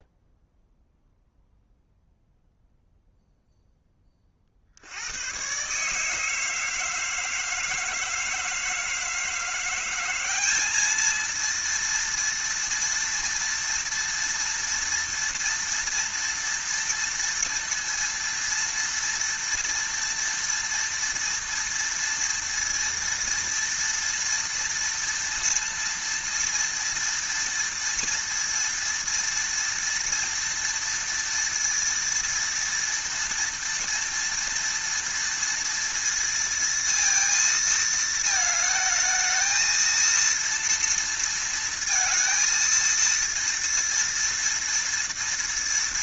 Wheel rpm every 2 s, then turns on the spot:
0, 0, 70, 160, 160, 210, 230, 230, 230, 230, 230, 230, 230, 230, 230, 230, 230, 230, 230, 220, 230, 230, 230.
none